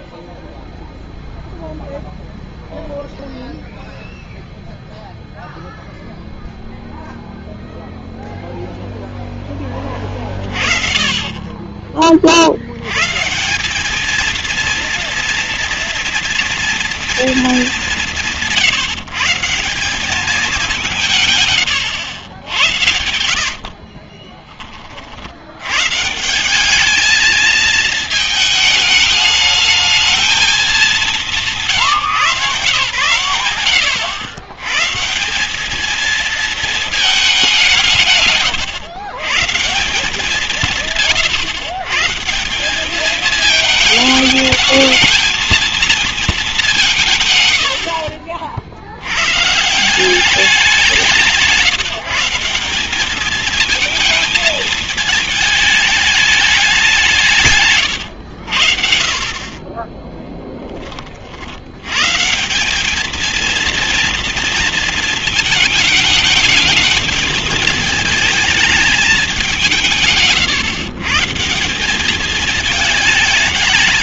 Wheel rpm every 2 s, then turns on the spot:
0, 0, 0, 0, 40, 60, 230, 230, 170, 190, 100, 20, 140, 220, 220, 150, 100, 220, 160, 160, 140, 220, 220, 50, 160, 160, 220, 210, 110, 20, 90, 230, 220, 220, 190, 170, 220.
22-24